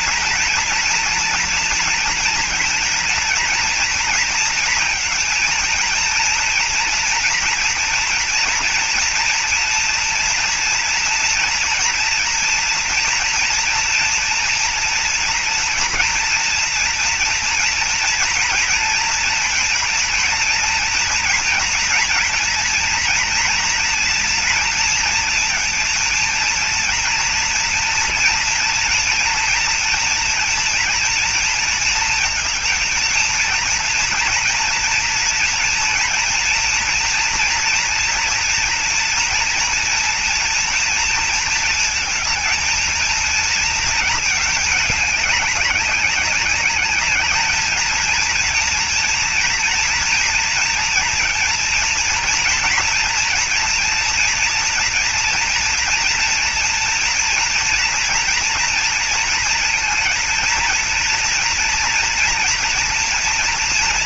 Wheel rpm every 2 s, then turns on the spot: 230, 230, 230, 240, 230, 230, 240, 230, 240, 230, 230, 230, 230, 230, 230, 230, 230, 230, 230, 230, 230, 230, 220, 200, 230, 230, 230, 230, 230, 230, 230, 230.
none